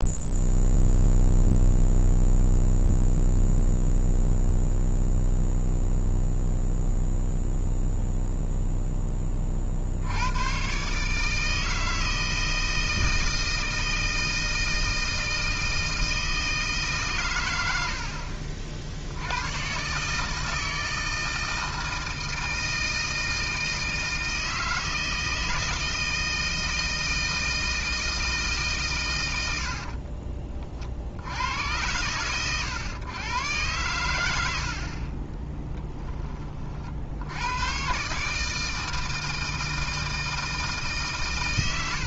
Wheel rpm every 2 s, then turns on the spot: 0, 0, 0, 0, 0, 130, 160, 160, 150, 60, 160, 160, 160, 160, 140, 40, 120, 60, 40, 160, 150.
none